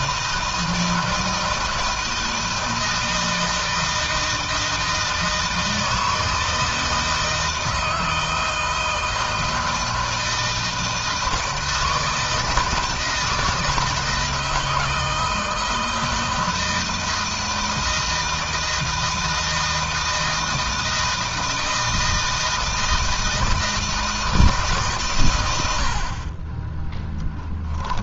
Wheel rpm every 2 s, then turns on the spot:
160, 160, 160, 160, 160, 160, 160, 160, 160, 160, 160, 160, 140, 10.
26-28